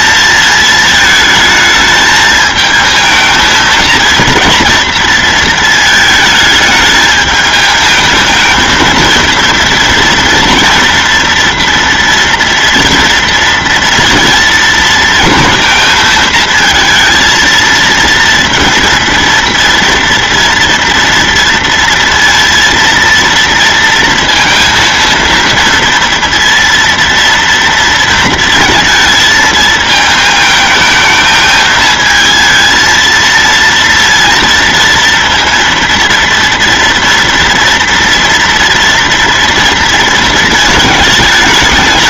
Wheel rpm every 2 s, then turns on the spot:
220, 220, 230, 210, 230, 240, 230, 230, 230, 230, 230, 230, 230, 230, 220, 220, 230, 230, 230, 230, 220.
none